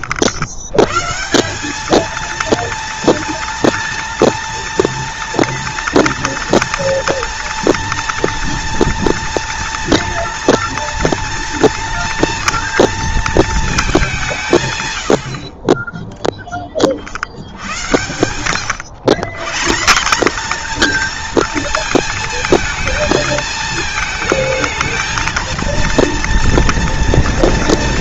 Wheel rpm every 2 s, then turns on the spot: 140, 230, 230, 230, 230, 230, 230, 120, 60, 130, 240, 220, 230, 230.
none